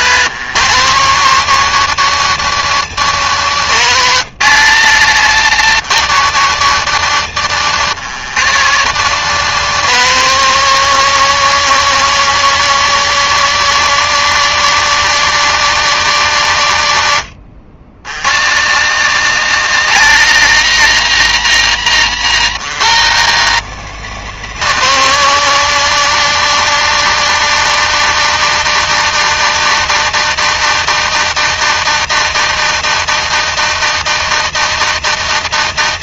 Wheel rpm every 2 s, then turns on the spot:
180, 180, 180, 170, 180, 190, 190, 200, 110, 190, 200, 180, 200, 200, 200, 200, 200, 200.
4-6